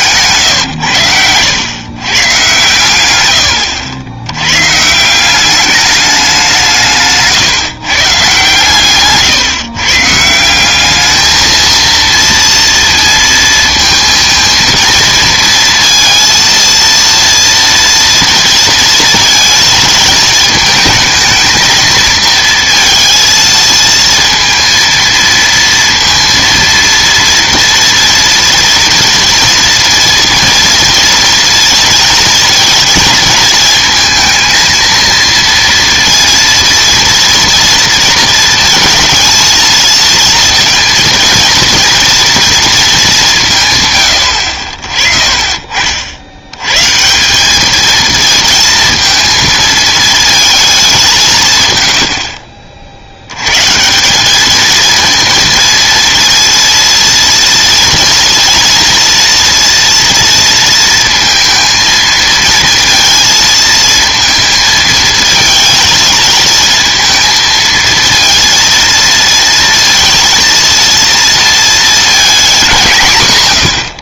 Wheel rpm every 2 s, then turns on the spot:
130, 110, 130, 160, 130, 190, 230, 230, 230, 230, 220, 230, 230, 230, 230, 230, 230, 230, 230, 220, 230, 220, 50, 120, 230, 200, 50, 220, 230, 230, 230, 230, 220, 220, 230, 230, 170.
none